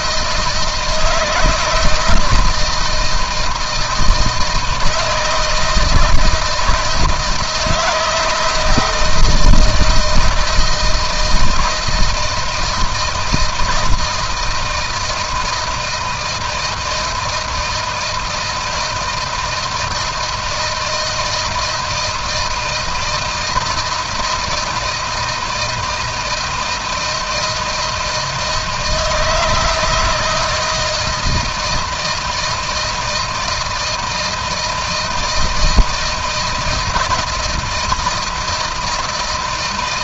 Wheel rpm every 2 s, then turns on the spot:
160, 160, 160, 160, 160, 170, 160, 160, 160, 160, 160, 160, 160, 160, 160, 160, 160, 160, 170, 170.
none